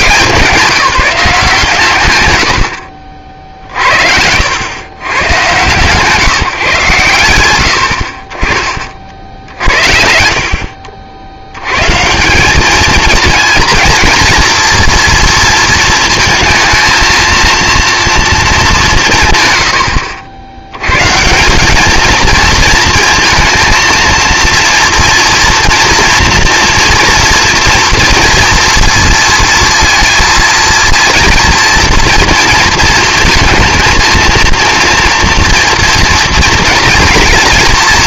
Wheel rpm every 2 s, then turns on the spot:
190, 90, 100, 150, 40, 60, 200, 230, 220, 210, 90, 230, 230, 230, 230, 230, 230, 230, 240.
none